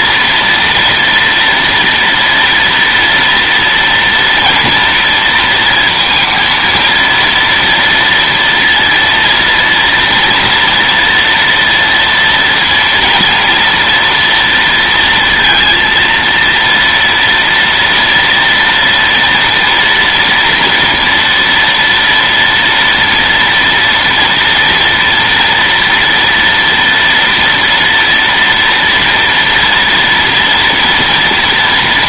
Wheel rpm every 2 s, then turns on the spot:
230, 230, 230, 230, 230, 230, 240, 230, 230, 230, 230, 230, 230, 230, 230, 230.
none